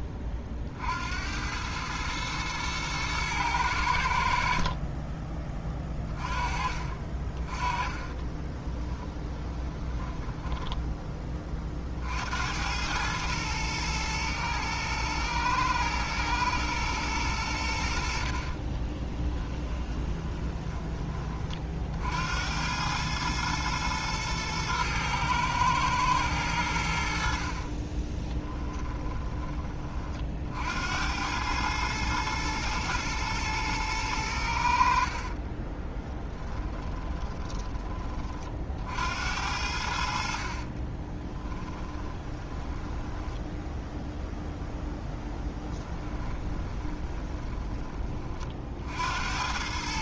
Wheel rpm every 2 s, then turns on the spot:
50, 110, 40, 40, 20, 10, 100, 110, 110, 30, 20, 100, 110, 80, 20, 70, 110, 60, 10, 60, 30, 10, 10, 20, 60.
8-10 18-20 28-30 36-38 40-44 46-48